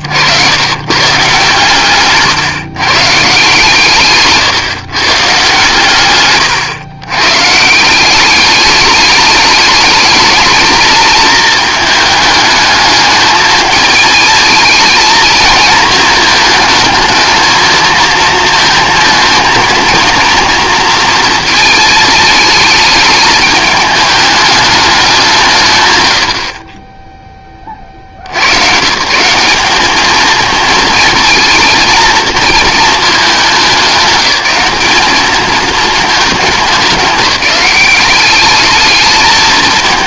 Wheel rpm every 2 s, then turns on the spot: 80, 140, 140, 120, 200, 220, 220, 220, 220, 230, 230, 210, 210, 50, 120, 220, 220, 200, 200, 200.
none